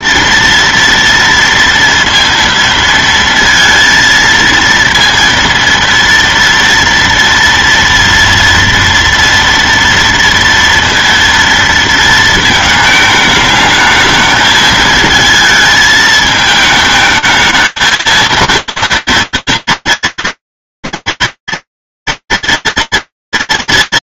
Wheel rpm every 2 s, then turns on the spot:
230, 230, 230, 230, 230, 230, 220, 220, 220, 230, 240, 230.
none